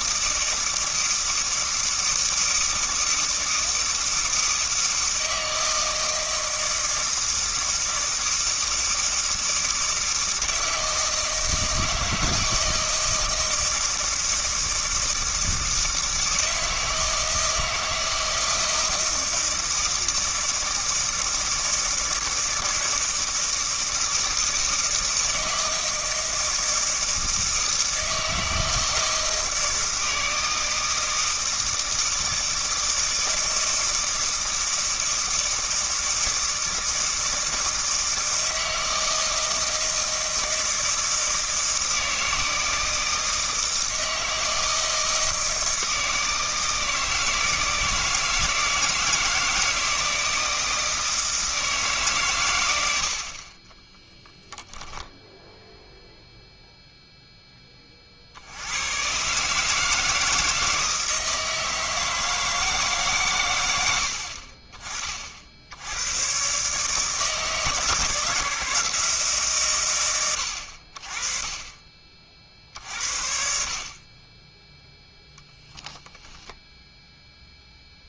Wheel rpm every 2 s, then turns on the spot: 160, 160, 160, 160, 160, 160, 160, 160, 160, 160, 160, 160, 160, 160, 160, 160, 160, 160, 160, 160, 160, 160, 160, 160, 160, 160, 100, 0, 0, 90, 160, 150, 40, 150, 160, 70, 50, 0, 10.
76-78